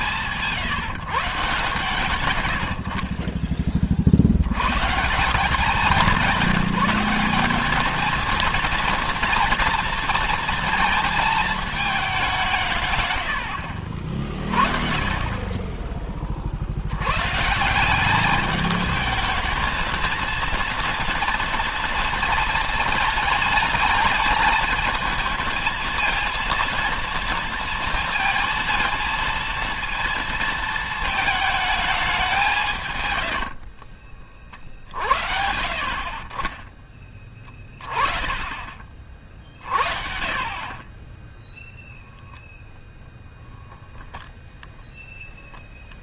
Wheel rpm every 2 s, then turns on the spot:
170, 100, 100, 190, 230, 230, 150, 50, 60, 210, 230, 230, 220, 230, 230, 230, 180, 50, 20, 30, 40, 0, 0.
none